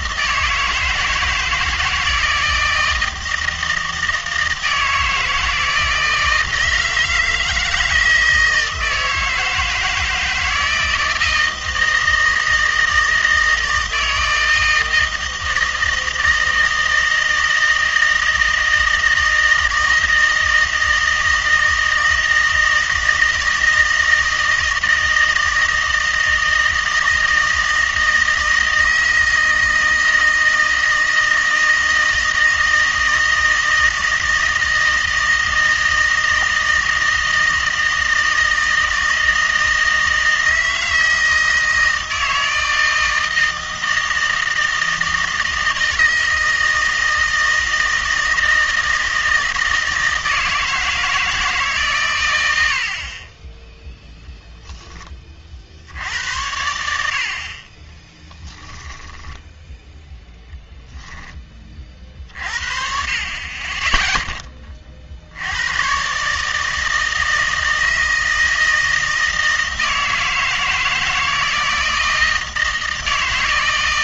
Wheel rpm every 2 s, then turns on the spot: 160, 160, 160, 160, 160, 160, 160, 160, 160, 160, 160, 160, 160, 160, 160, 160, 160, 160, 160, 160, 160, 160, 160, 160, 160, 160, 70, 10, 90, 10, 10, 40, 30, 160, 160, 160, 160.
58-62